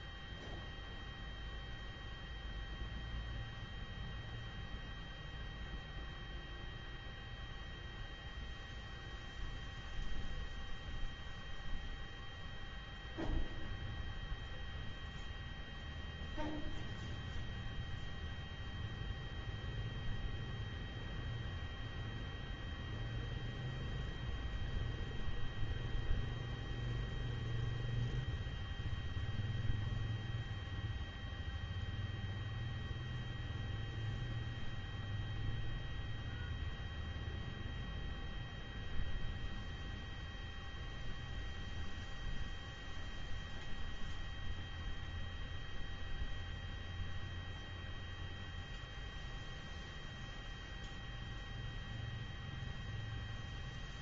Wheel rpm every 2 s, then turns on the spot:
0, 0, 0, 0, 0, 0, 0, 0, 0, 0, 0, 0, 0, 0, 0, 0, 0, 0, 0, 0, 0, 0, 0, 0, 0, 0, 0.
none